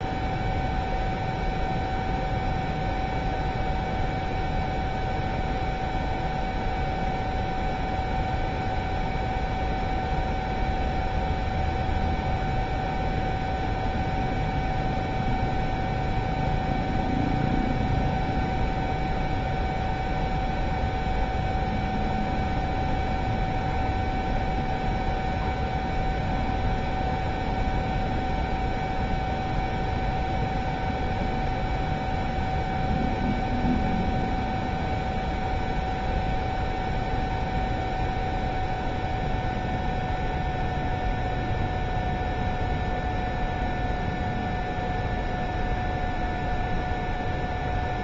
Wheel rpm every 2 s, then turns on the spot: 0, 0, 0, 0, 0, 0, 0, 0, 0, 0, 0, 0, 0, 0, 0, 0, 0, 0, 0, 0, 0, 0, 0, 0.
none